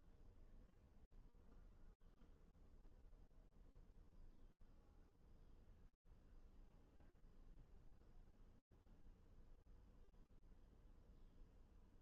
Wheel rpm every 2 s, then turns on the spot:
0, 0, 0, 0, 0, 0.
none